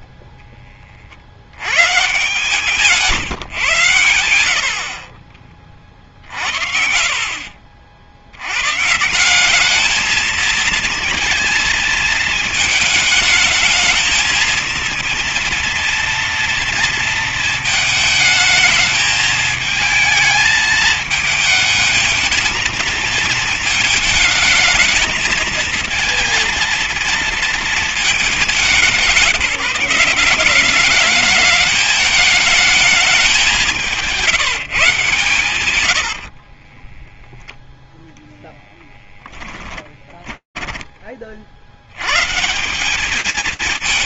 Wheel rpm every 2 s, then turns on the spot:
30, 180, 50, 60, 120, 230, 220, 230, 230, 220, 220, 220, 220, 230, 190, 200, 220, 160, 20, 10, 50, 200.
2-8 36-40